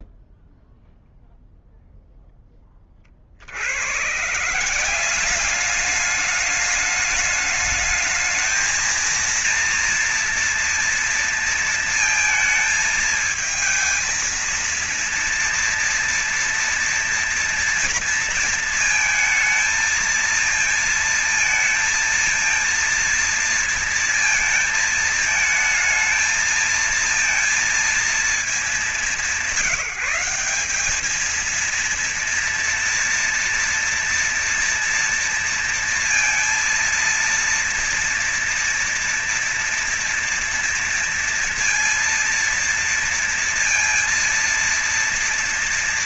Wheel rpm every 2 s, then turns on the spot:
0, 0, 130, 210, 220, 230, 220, 230, 230, 230, 230, 230, 230, 220, 220, 190, 240, 230, 230, 230, 230, 230, 230.
none